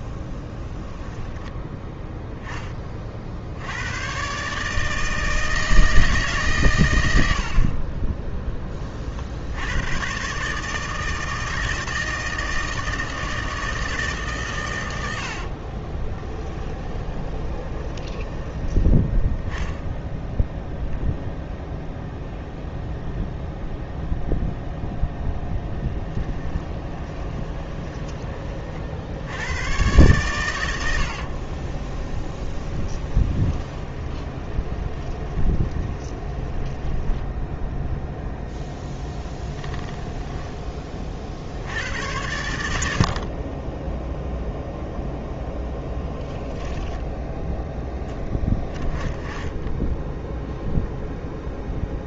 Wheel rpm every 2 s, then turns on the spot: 10, 30, 160, 100, 30, 160, 160, 110, 30, 10, 10, 0, 0, 20, 50, 90, 20, 20, 10, 0, 30, 70, 0, 10, 20, 0.
16-18 26-28 32-38